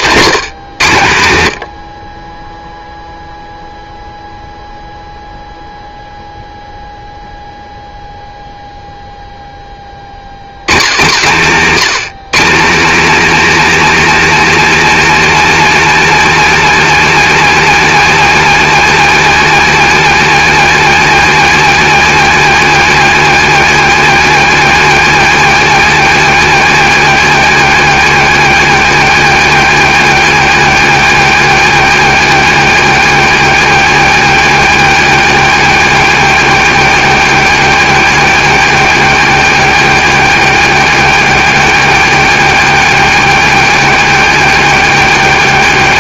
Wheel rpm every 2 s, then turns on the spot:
190, 10, 0, 0, 0, 80, 220, 300, 290, 290, 290, 290, 280, 280, 280, 280, 280, 280, 280, 280, 280, 280, 280.
2-4